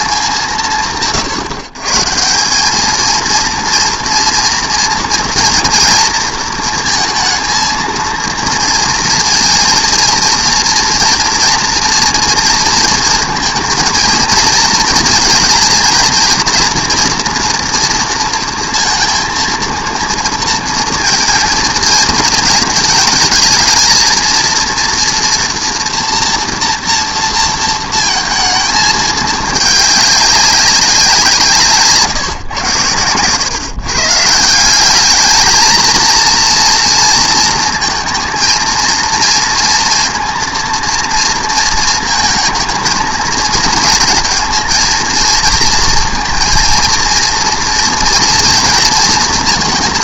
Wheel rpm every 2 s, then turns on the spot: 140, 230, 230, 230, 230, 230, 230, 240, 230, 230, 220, 220, 230, 220, 210, 150, 140, 220, 230, 230, 230, 230, 230, 230, 220.
none